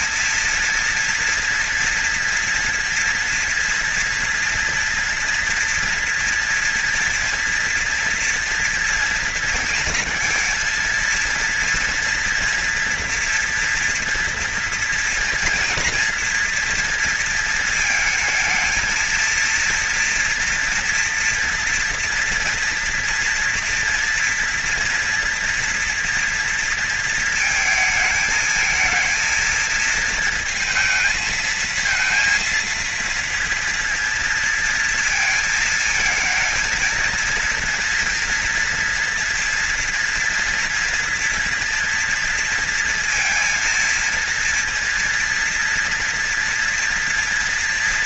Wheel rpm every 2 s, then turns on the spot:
230, 230, 230, 230, 230, 230, 230, 230, 230, 220, 230, 240, 240, 230, 220, 220, 230, 230, 230, 230, 230, 230, 230, 230.
none